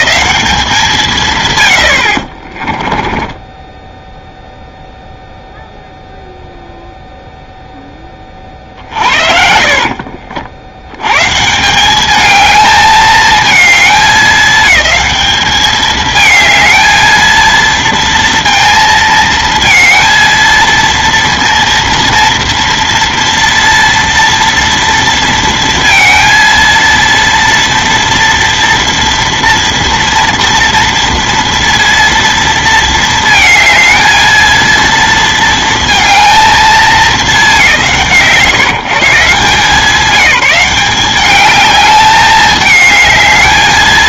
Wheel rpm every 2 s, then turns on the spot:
200, 20, 0, 0, 30, 70, 220, 210, 220, 230, 230, 230, 230, 230, 230, 230, 230, 230, 220, 140, 190, 210.
2-4 8-10